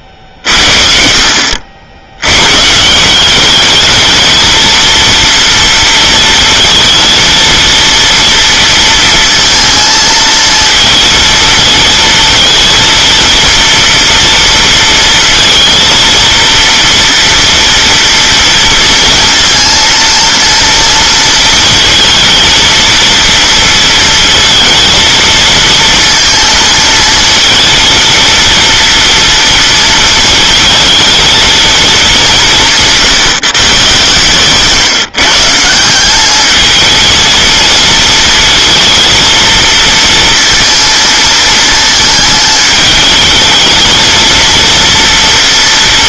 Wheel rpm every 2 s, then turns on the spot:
50, 170, 230, 230, 230, 220, 230, 230, 230, 230, 230, 230, 230, 230, 230, 230, 150, 160, 230, 230, 220, 220, 240.
none